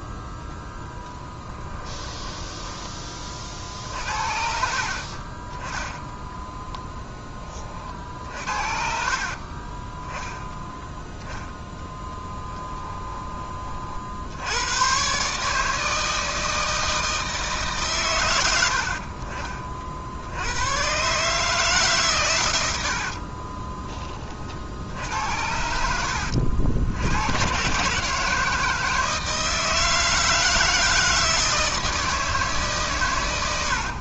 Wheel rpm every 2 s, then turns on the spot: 10, 10, 50, 10, 50, 10, 10, 100, 160, 80, 100, 80, 60, 80, 160, 160, 150.
12-14